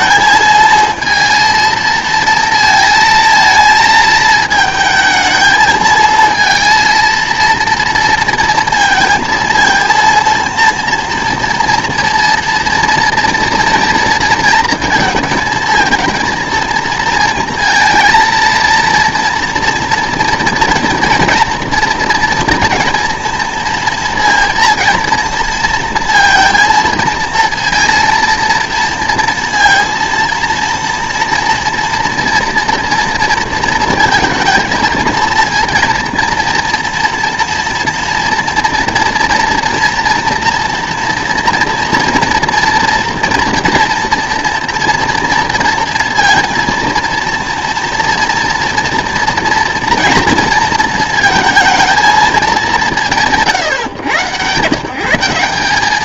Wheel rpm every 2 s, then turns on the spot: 220, 230, 220, 230, 230, 230, 230, 230, 220, 230, 230, 230, 230, 230, 230, 230, 230, 220, 230, 230, 230, 230, 230, 230, 230, 230, 200, 120.
none